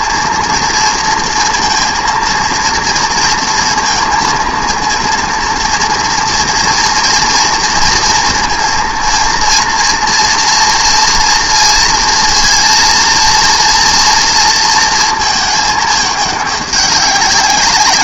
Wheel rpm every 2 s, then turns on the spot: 230, 230, 230, 230, 230, 230, 230, 230, 200.
none